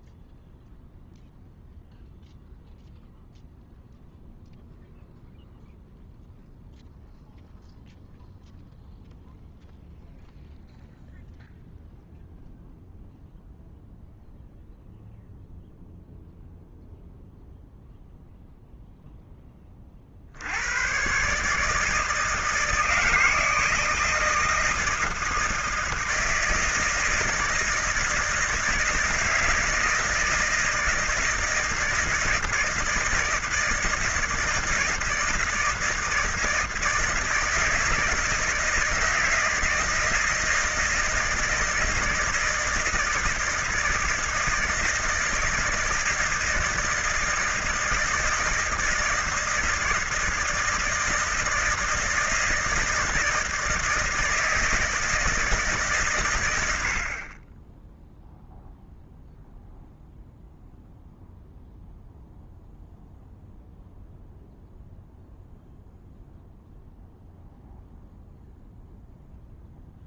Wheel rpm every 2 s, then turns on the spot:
0, 0, 0, 0, 0, 0, 0, 0, 0, 0, 90, 160, 160, 160, 160, 160, 160, 160, 160, 160, 160, 160, 160, 160, 160, 160, 160, 160, 110, 0, 0, 0, 0, 0, 0.
none